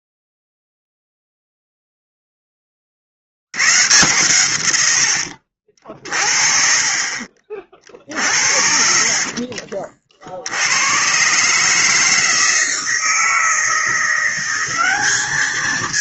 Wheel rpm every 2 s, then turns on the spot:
0, 40, 90, 40, 50, 100, 160, 190.
none